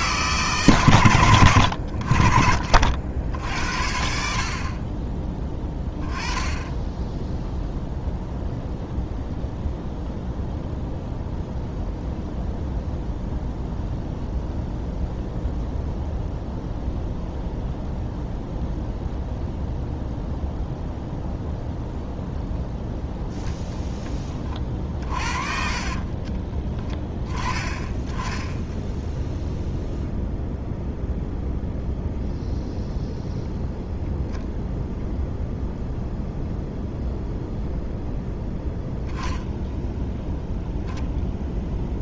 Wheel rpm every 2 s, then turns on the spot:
140, 50, 50, 20, 0, 0, 0, 0, 0, 0, 0, 0, 30, 20, 10, 0, 0, 0, 0, 0, 0.
26-28